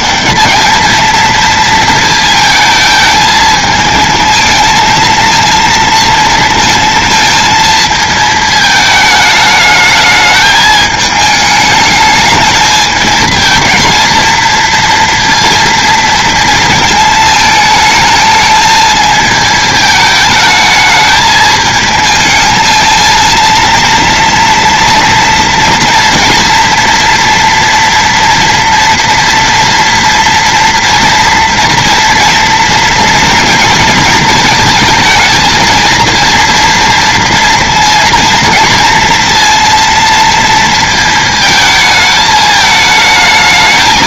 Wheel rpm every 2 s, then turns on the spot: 200, 220, 230, 230, 220, 220, 220, 230, 230, 220, 220, 220, 230, 230, 230, 230, 240, 220, 230, 230, 230, 220.
none